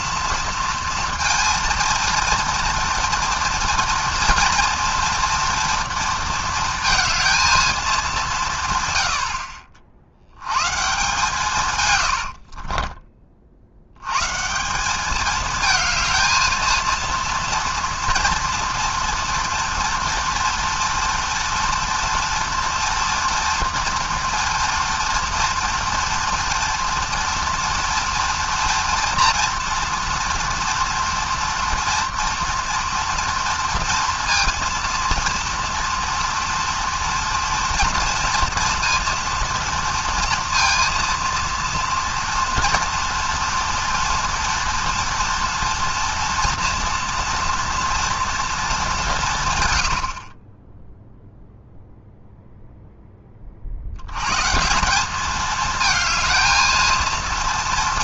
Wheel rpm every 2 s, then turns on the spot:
230, 230, 230, 230, 160, 130, 50, 170, 230, 240, 230, 230, 230, 230, 230, 230, 230, 230, 230, 230, 230, 230, 240, 230, 220, 20, 0, 150, 220.
12-14